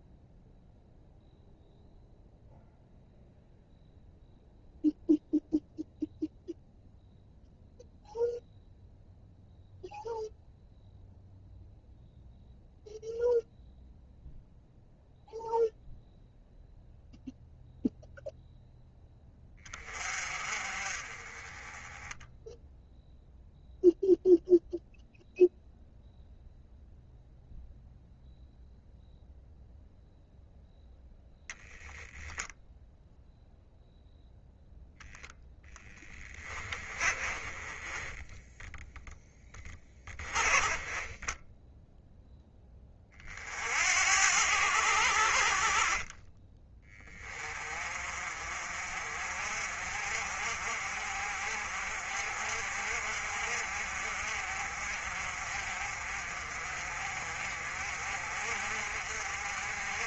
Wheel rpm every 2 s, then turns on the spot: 0, 0, 0, 0, 0, 0, 0, 0, 0, 0, 30, 0, 0, 0, 0, 0, 10, 0, 20, 0, 20, 20, 80, 20, 50, 50, 50, 50, 40, 50.
36-38 40-42